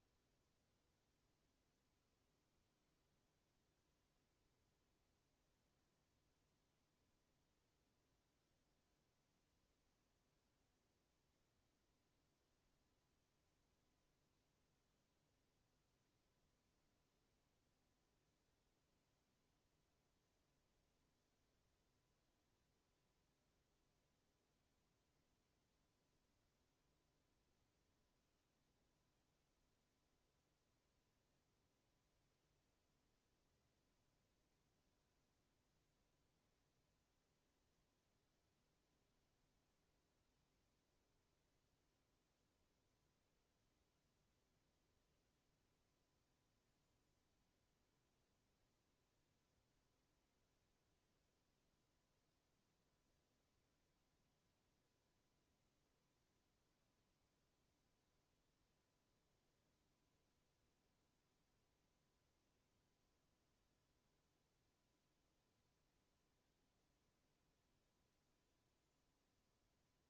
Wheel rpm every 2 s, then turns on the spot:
0, 0, 0, 0, 0, 0, 0, 0, 0, 0, 0, 0, 0, 0, 0, 0, 0, 0, 0, 0, 0, 0, 0, 0, 0, 0, 0, 0, 0, 0, 0, 0, 0, 0, 0.
none